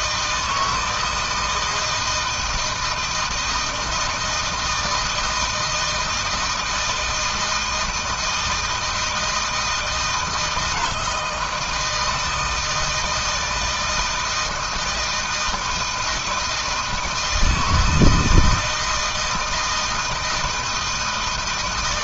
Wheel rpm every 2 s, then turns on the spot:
160, 160, 160, 170, 160, 160, 160, 160, 160, 160, 160.
none